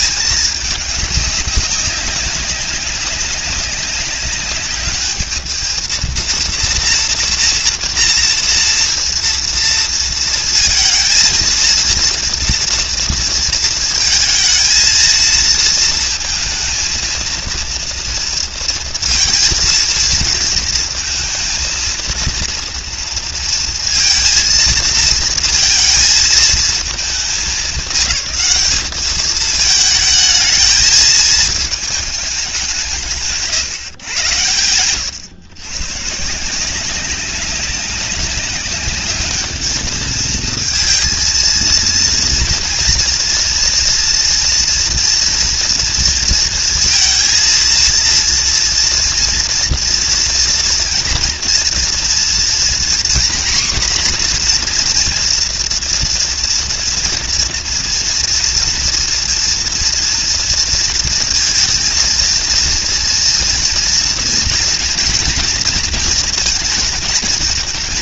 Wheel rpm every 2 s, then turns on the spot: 210, 200, 210, 230, 230, 230, 230, 230, 230, 230, 220, 230, 230, 210, 200, 220, 160, 120, 190, 210, 230, 240, 240, 230, 230, 230, 250, 240, 230, 230, 230, 230, 230, 230.
none